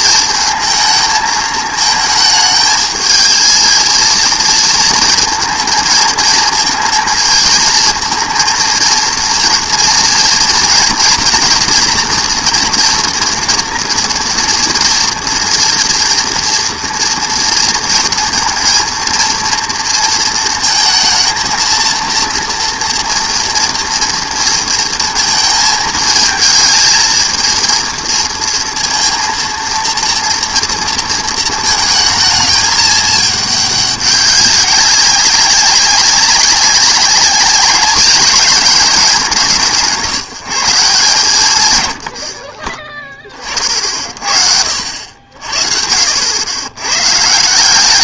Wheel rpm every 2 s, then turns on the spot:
220, 220, 230, 230, 230, 240, 240, 230, 230, 230, 230, 230, 230, 220, 230, 230, 220, 200, 190, 210, 160, 30, 70, 110.
none